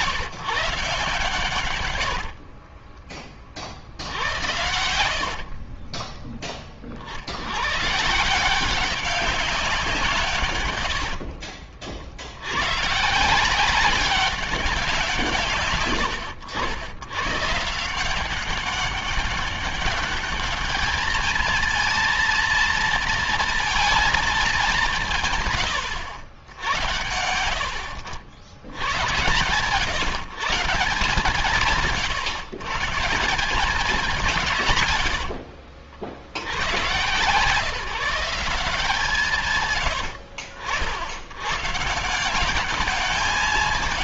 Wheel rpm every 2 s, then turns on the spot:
150, 40, 80, 30, 170, 120, 90, 190, 90, 190, 210, 230, 190, 90, 90, 150, 130, 150, 90, 170, 80, 190.
2-6 10-12